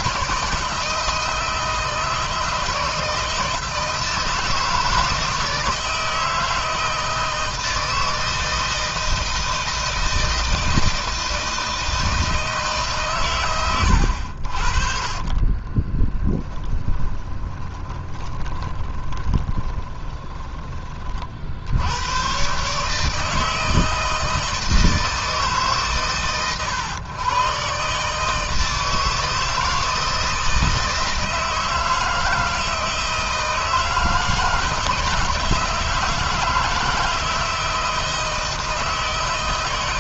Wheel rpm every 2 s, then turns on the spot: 160, 160, 160, 160, 160, 170, 150, 50, 20, 10, 30, 150, 160, 130, 160, 160, 160, 160, 160, 160.
16-20